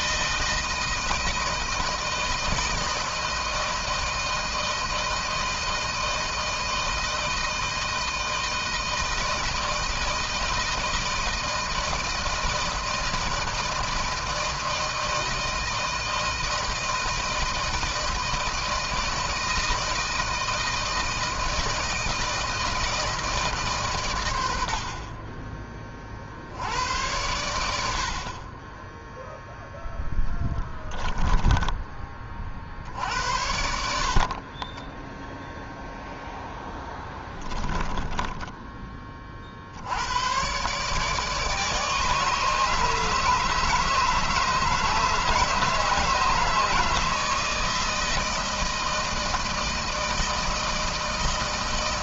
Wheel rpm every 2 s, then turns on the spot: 160, 160, 160, 160, 160, 160, 160, 160, 160, 160, 160, 160, 110, 60, 40, 10, 40, 40, 0, 10, 110, 150, 150, 150, 160, 160.
30-32 34-36 38-40